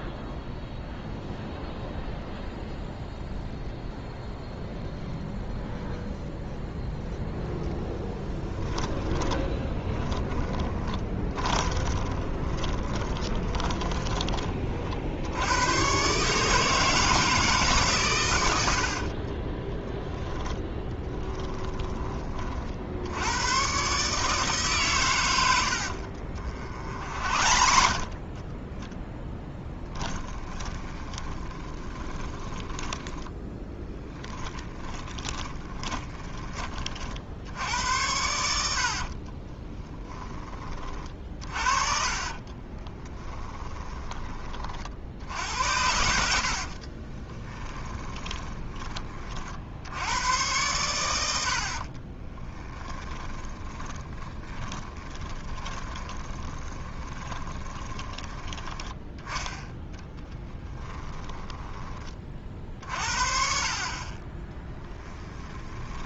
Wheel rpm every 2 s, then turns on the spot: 0, 0, 0, 0, 10, 20, 30, 50, 160, 60, 10, 50, 140, 50, 10, 20, 10, 20, 50, 60, 30, 20, 50, 50, 20, 90, 10, 20, 20, 10, 20, 50, 20.
8-14 18-22 26-36 38-40 42-44 46-48 52-58 60-62 64-66